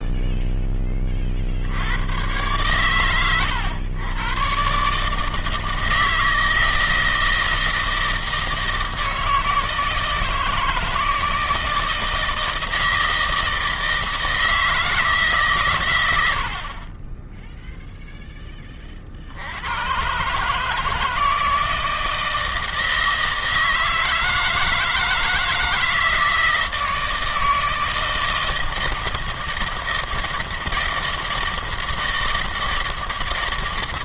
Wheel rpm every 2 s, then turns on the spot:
20, 110, 140, 160, 160, 160, 160, 160, 30, 40, 160, 160, 160, 160, 160, 160, 160.
none